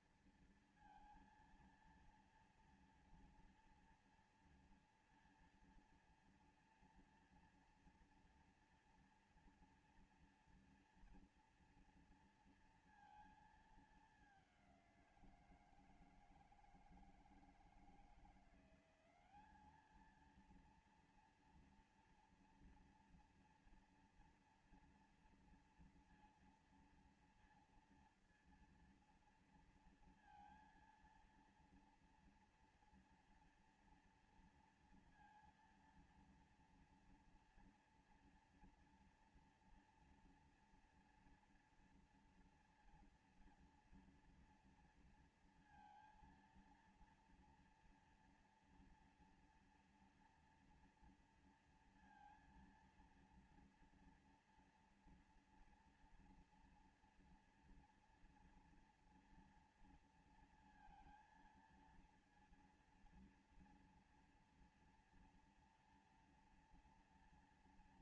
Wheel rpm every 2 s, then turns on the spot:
230, 230, 240, 230, 230, 240, 230, 190, 160, 180, 230, 230, 230, 230, 230, 230, 230, 230, 230, 230, 230, 230, 230, 230, 230, 240, 230, 230, 240, 230, 230, 230, 240, 230.
none